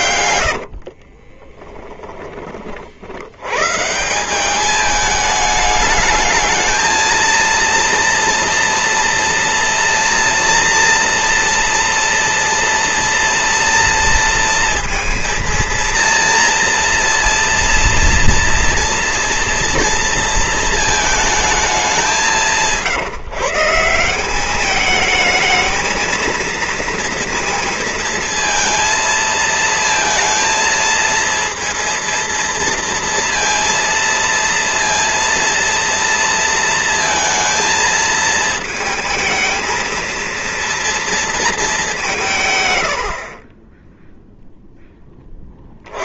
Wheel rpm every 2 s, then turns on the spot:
50, 60, 210, 220, 230, 230, 240, 230, 230, 230, 220, 170, 210, 230, 230, 230, 230, 230, 230, 220, 230, 90, 10.
0-2